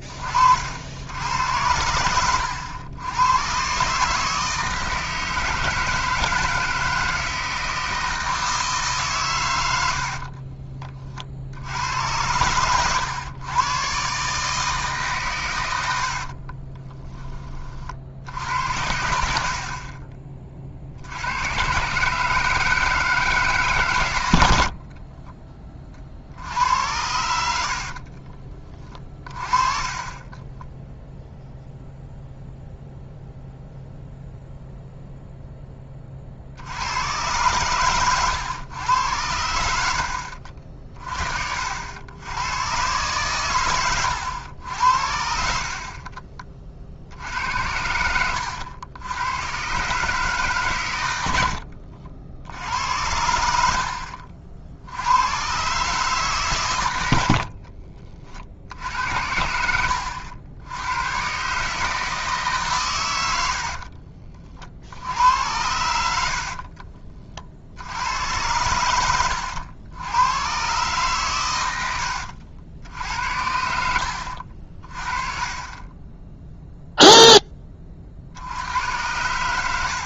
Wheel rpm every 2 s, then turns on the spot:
70, 90, 160, 160, 150, 40, 110, 150, 20, 80, 50, 160, 50, 80, 30, 20, 0, 0, 90, 100, 50, 120, 70, 50, 90, 120, 80, 70, 120, 60, 100, 120, 60, 40, 100, 130, 70, 40, 0, 90.
16-18 30-32 66-68